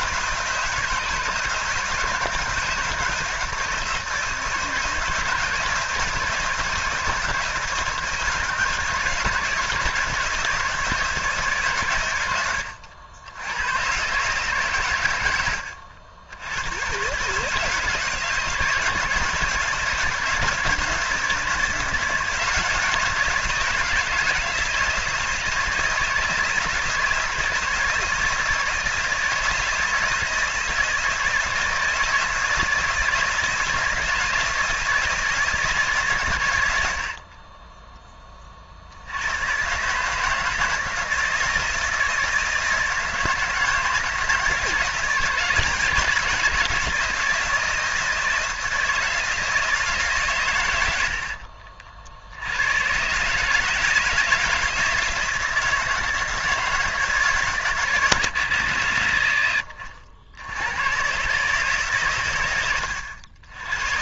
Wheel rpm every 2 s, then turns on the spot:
170, 170, 160, 160, 160, 160, 90, 130, 110, 150, 160, 170, 160, 160, 160, 160, 160, 160, 80, 60, 160, 160, 160, 160, 160, 100, 100, 160, 160, 70, 100, 100.
none